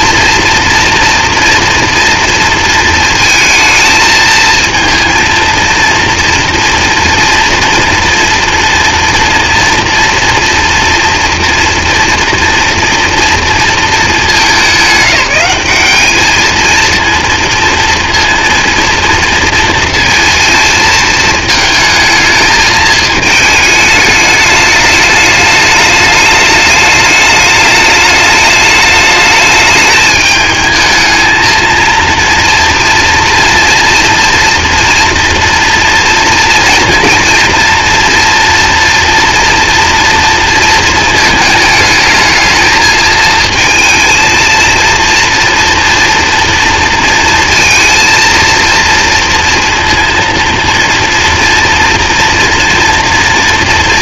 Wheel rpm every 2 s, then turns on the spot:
240, 230, 230, 230, 230, 230, 230, 210, 220, 230, 230, 220, 210, 210, 210, 220, 230, 230, 240, 240, 230, 220, 230, 230, 230, 230, 230.
none